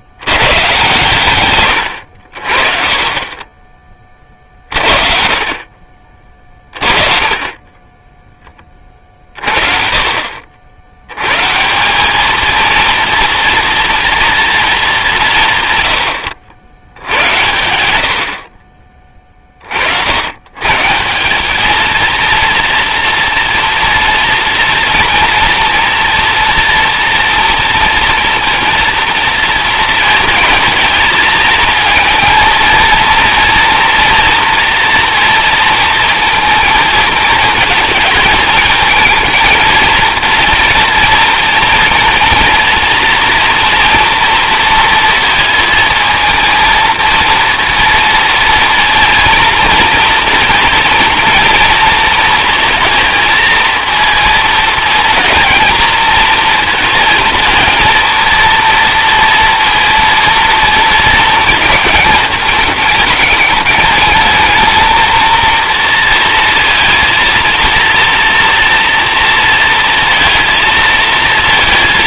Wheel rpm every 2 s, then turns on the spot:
130, 30, 50, 30, 40, 130, 230, 150, 110, 30, 190, 230, 230, 230, 230, 220, 230, 230, 220, 230, 230, 230, 230, 230, 230, 240, 230, 230, 220, 230, 220, 210, 230, 230, 230, 230.
none